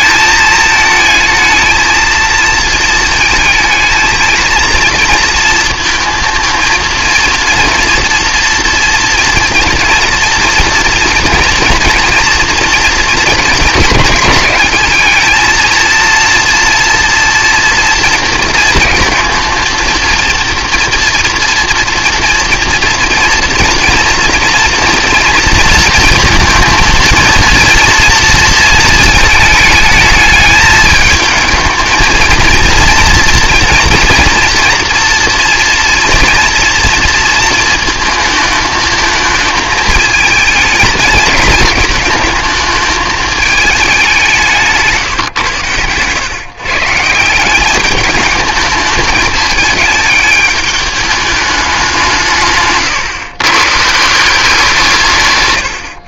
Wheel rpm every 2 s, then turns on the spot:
220, 220, 230, 230, 230, 230, 230, 210, 240, 230, 230, 240, 230, 230, 230, 210, 230, 230, 230, 220, 220, 220, 170, 130, 210, 210, 140, 160.
none